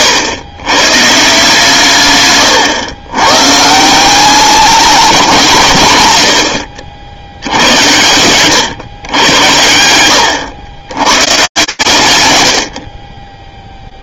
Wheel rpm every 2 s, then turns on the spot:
120, 130, 210, 70, 130, 70, 90.
none